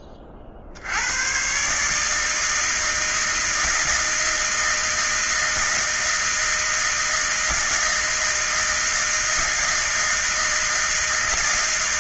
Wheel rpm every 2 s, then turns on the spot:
50, 160, 160, 160, 160, 160.
none